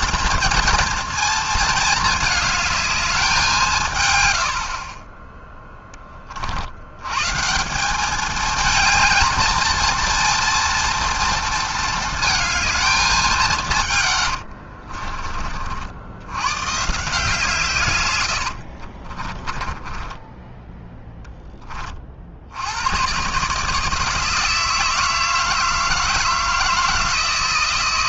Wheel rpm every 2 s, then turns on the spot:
230, 220, 70, 60, 220, 230, 220, 60, 120, 80, 10, 80, 160, 160.
14-16 18-22